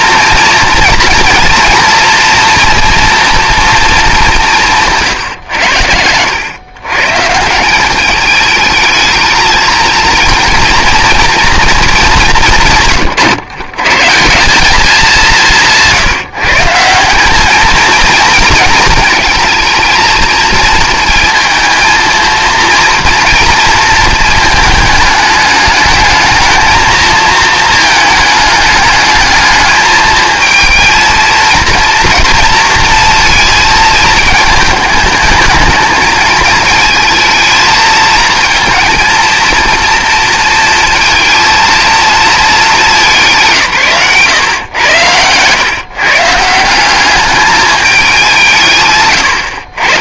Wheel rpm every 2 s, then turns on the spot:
230, 230, 160, 120, 220, 230, 150, 190, 160, 220, 230, 230, 220, 220, 210, 230, 230, 210, 220, 230, 230, 220, 110, 180, 140.
none